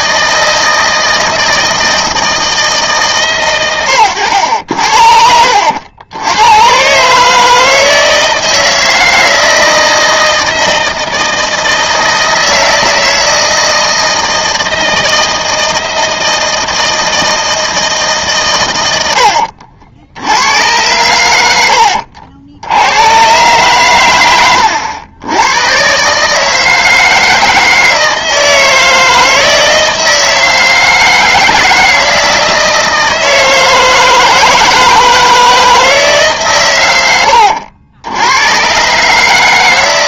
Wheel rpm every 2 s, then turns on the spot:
160, 160, 80, 120, 160, 160, 160, 160, 160, 110, 100, 80, 100, 160, 160, 160, 160, 160, 110, 120.
none